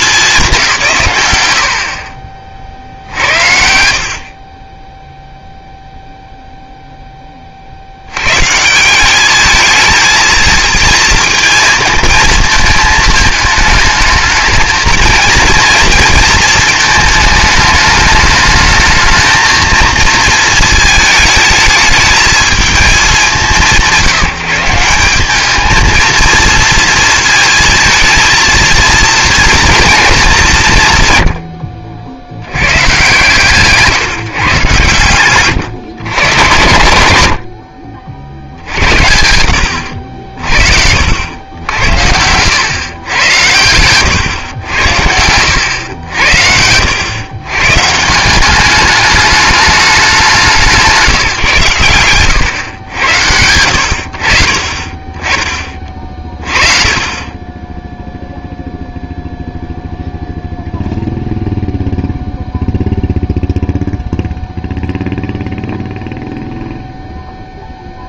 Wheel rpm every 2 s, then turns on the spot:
170, 50, 30, 0, 150, 230, 220, 220, 230, 220, 220, 220, 170, 230, 230, 170, 110, 140, 110, 70, 60, 110, 100, 80, 200, 170, 110, 40, 30, 0, 0, 0, 0, 0.
none